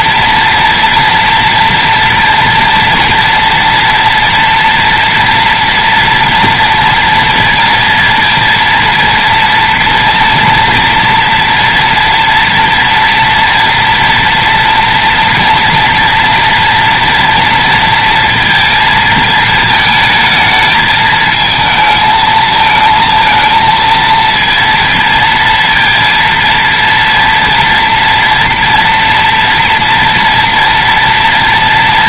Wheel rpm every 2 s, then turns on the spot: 230, 230, 240, 230, 230, 230, 240, 230, 230, 230, 220, 220, 230, 230, 230, 230.
none